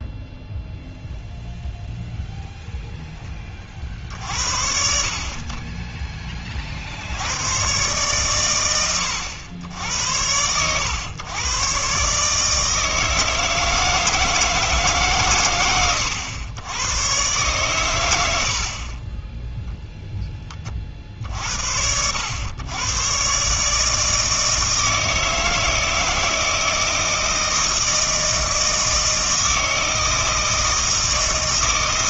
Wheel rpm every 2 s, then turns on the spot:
0, 0, 60, 60, 110, 110, 150, 150, 110, 40, 40, 110, 160, 160, 160, 160.
none